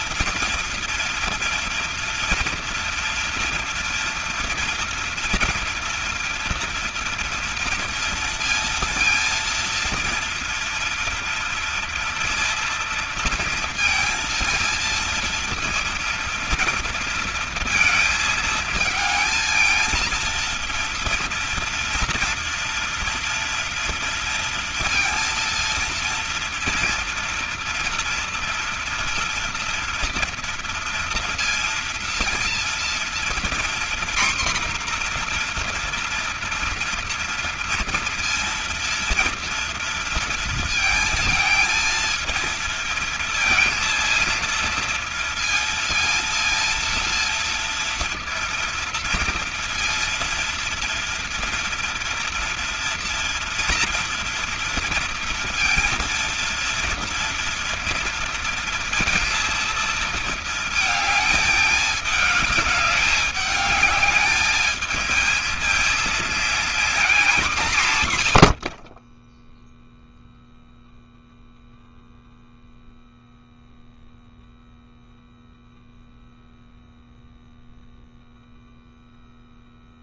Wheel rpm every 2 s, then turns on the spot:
230, 230, 230, 230, 230, 230, 230, 230, 230, 220, 230, 230, 230, 230, 230, 230, 230, 250, 230, 230, 230, 230, 230, 230, 230, 230, 230, 230, 230, 230, 220, 210, 210, 230, 80, 0, 0, 0, 0, 0.
none